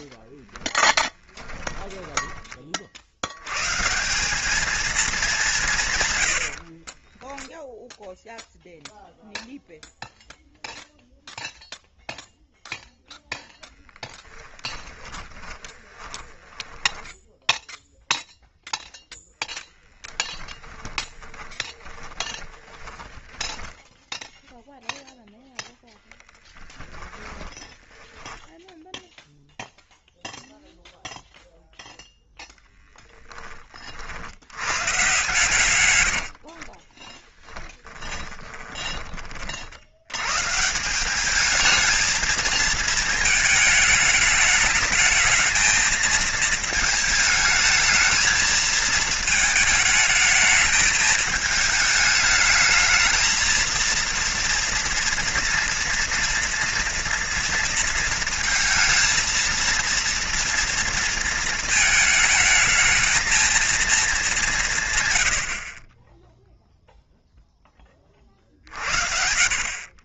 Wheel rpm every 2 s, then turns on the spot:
10, 50, 210, 40, 0, 0, 0, 20, 10, 0, 10, 20, 0, 20, 10, 0, 10, 120, 40, 20, 170, 230, 220, 220, 220, 210, 220, 230, 230, 230, 230, 220, 130, 0, 60.
0-2 6-8 14-18 20-24 26-30 36-40